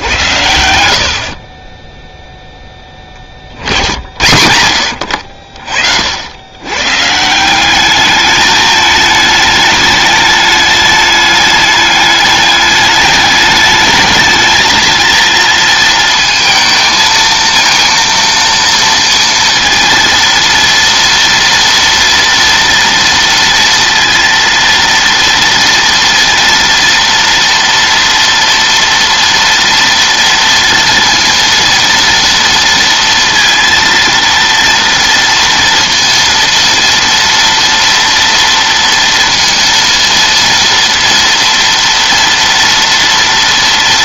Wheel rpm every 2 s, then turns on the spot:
80, 10, 80, 110, 210, 210, 210, 220, 230, 230, 230, 230, 230, 230, 230, 230, 230, 230, 230, 230, 230, 230.
none